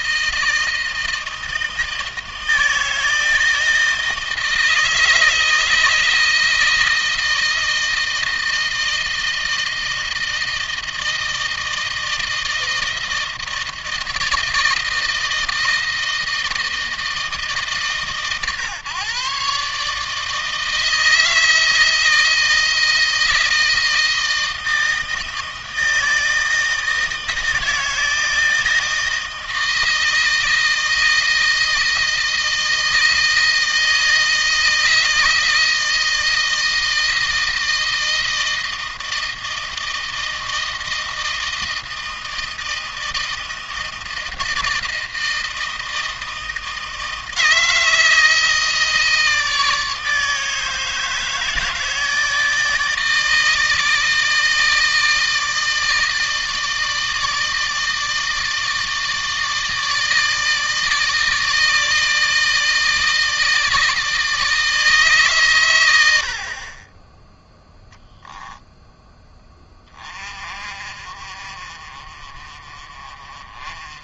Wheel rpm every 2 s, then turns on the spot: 160, 160, 160, 160, 160, 160, 160, 160, 160, 130, 160, 160, 160, 160, 160, 160, 160, 160, 160, 160, 160, 160, 160, 160, 160, 150, 160, 160, 160, 160, 160, 160, 140, 20, 10, 40, 30.
none